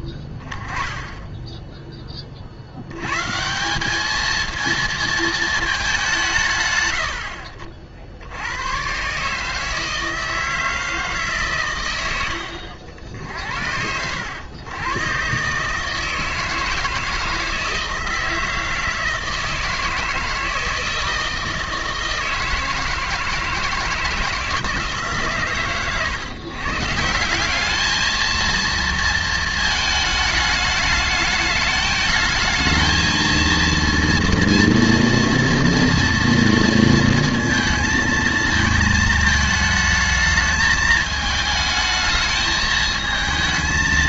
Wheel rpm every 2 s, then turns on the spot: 10, 60, 230, 130, 100, 160, 70, 100, 160, 160, 160, 160, 160, 140, 230, 210, 220, 230, 230, 220, 220, 220.
none